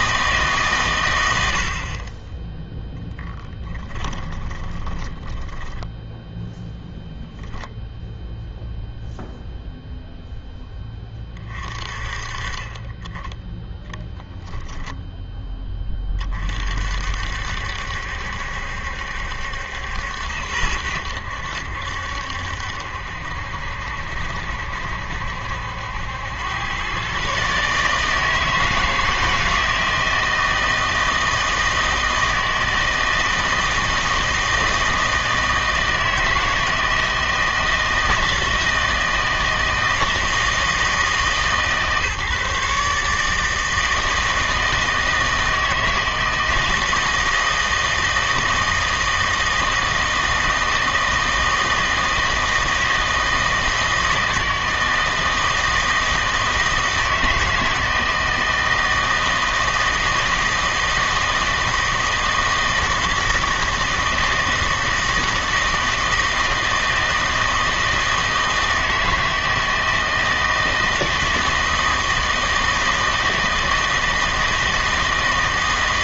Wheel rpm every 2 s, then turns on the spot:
140, 10, 20, 0, 0, 10, 20, 10, 50, 70, 80, 70, 70, 110, 160, 160, 160, 160, 160, 170, 160, 140, 160, 160, 160, 160, 160, 160, 160, 160, 160, 160, 160, 160, 160, 160, 160, 160.
4-6